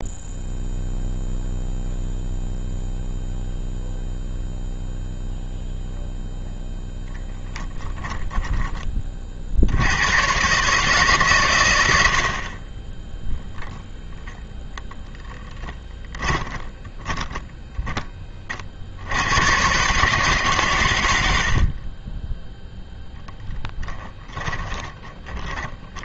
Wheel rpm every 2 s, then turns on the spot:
0, 0, 0, 0, 10, 140, 20, 0, 20, 50, 140, 10, 20.
16-18 24-26